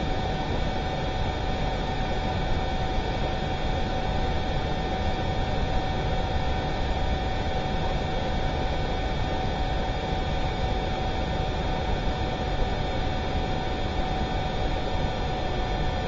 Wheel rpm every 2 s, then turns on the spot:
0, 0, 0, 0, 0, 0, 0, 0.
none